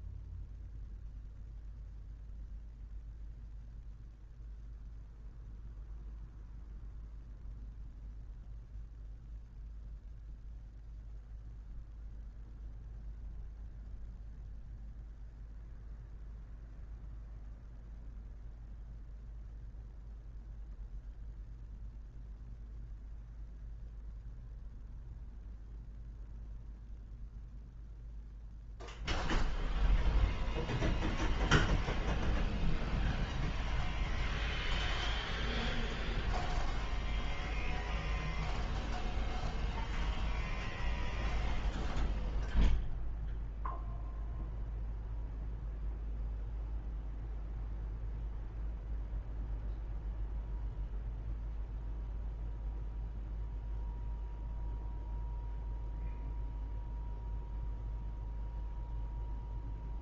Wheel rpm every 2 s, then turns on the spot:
0, 0, 0, 0, 0, 0, 0, 0, 0, 0, 0, 0, 0, 0, 0, 0, 0, 0, 0, 0, 0, 0, 0, 0, 0, 0, 0, 0, 0, 0.
none